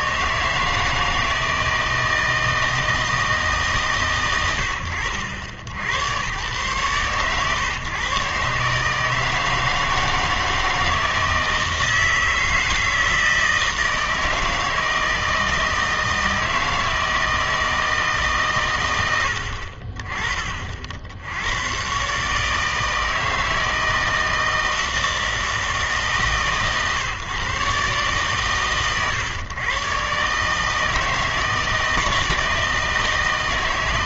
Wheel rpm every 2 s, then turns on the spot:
160, 160, 100, 120, 150, 160, 160, 160, 160, 130, 50, 160, 160, 140, 120, 150, 160.
none